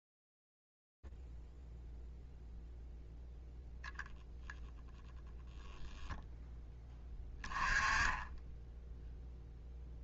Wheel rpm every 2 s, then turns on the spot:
0, 0, 0, 10, 10.
none